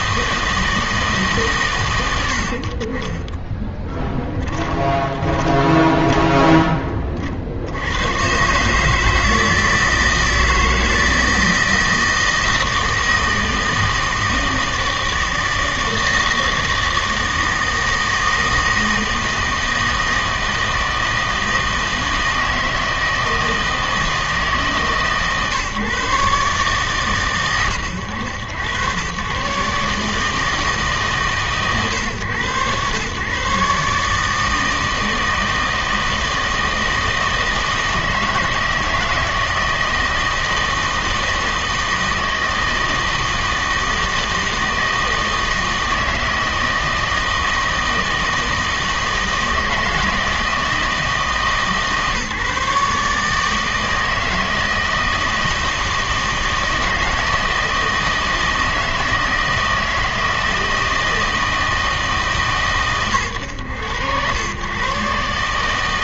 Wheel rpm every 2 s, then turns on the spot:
160, 50, 10, 20, 140, 160, 160, 160, 160, 160, 160, 160, 150, 140, 100, 150, 120, 160, 160, 160, 160, 160, 160, 160, 160, 160, 150, 160, 160, 160, 160, 120, 120.
4-6